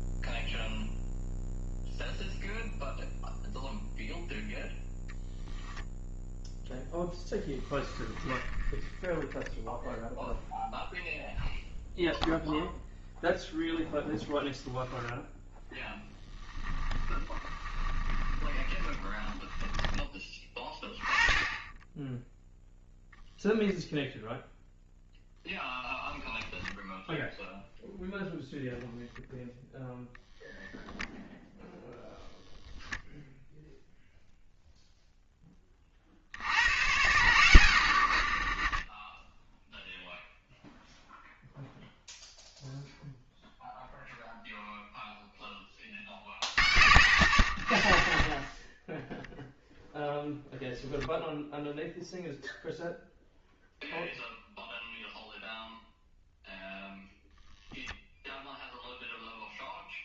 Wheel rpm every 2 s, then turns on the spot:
0, 0, 0, 0, 20, 0, 0, 0, 10, 30, 20, 0, 0, 0, 0, 0, 10, 0, 100, 20, 0, 0, 0, 60, 0, 0, 0, 0, 0, 0.
8-10 16-20